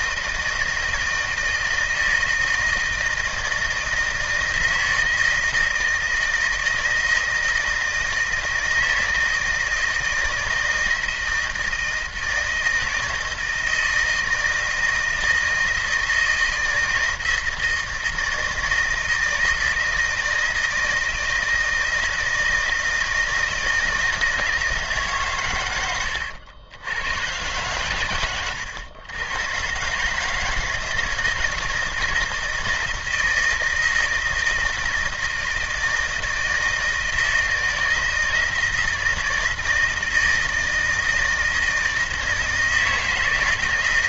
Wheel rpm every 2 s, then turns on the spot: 160, 160, 160, 160, 170, 160, 160, 170, 160, 160, 160, 160, 160, 90, 100, 160, 160, 160, 160, 160, 160, 160.
none